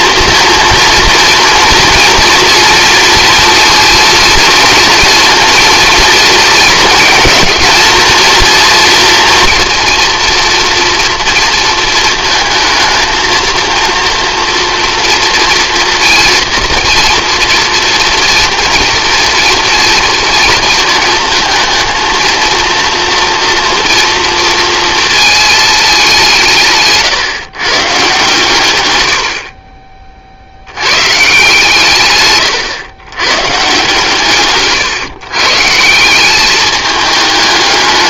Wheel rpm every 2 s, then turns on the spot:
230, 230, 230, 230, 230, 230, 230, 230, 230, 230, 230, 230, 230, 150, 120, 80, 120, 130, 210.
none